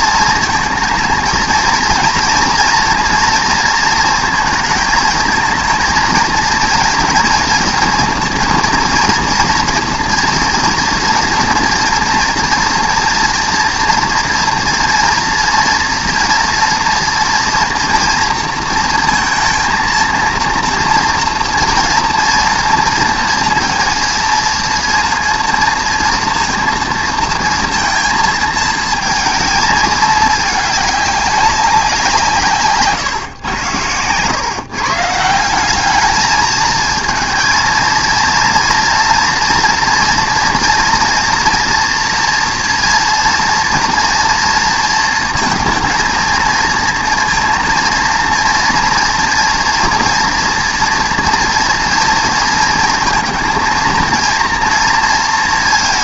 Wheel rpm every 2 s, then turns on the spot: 230, 230, 230, 230, 230, 240, 240, 230, 230, 230, 230, 230, 230, 230, 220, 210, 150, 140, 220, 230, 230, 230, 230, 230, 230, 230, 230, 230.
none